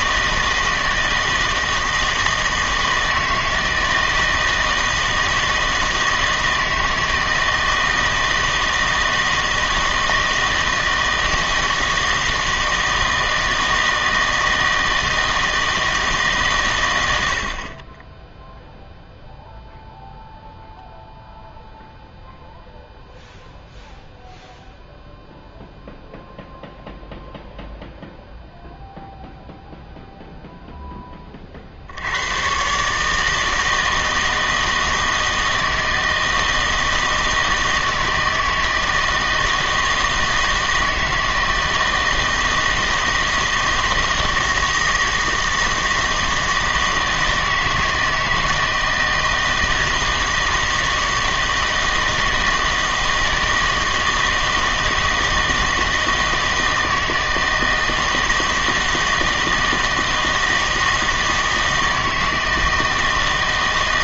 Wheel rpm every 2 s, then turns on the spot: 160, 160, 160, 160, 160, 160, 160, 160, 130, 0, 0, 0, 0, 0, 0, 0, 120, 160, 160, 160, 160, 160, 160, 160, 160, 160, 160, 160, 160, 160, 160, 160.
none